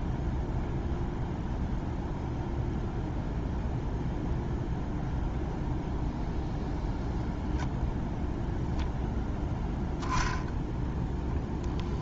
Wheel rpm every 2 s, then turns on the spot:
0, 0, 0, 0, 0, 0.
none